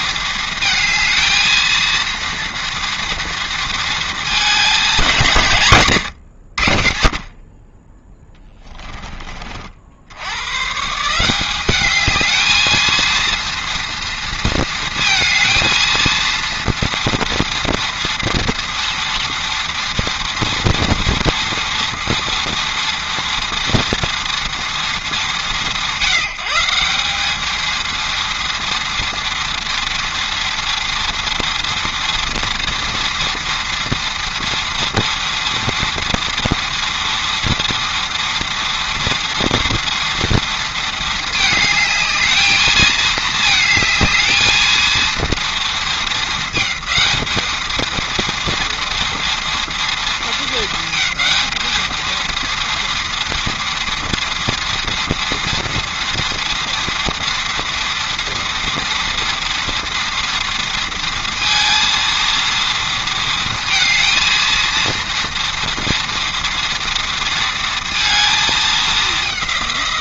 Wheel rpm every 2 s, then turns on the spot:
220, 230, 210, 70, 20, 130, 220, 230, 230, 230, 230, 230, 210, 180, 230, 230, 230, 230, 230, 240, 230, 220, 220, 220, 230, 220, 230, 230, 230, 230, 230, 230, 230, 230, 220.
none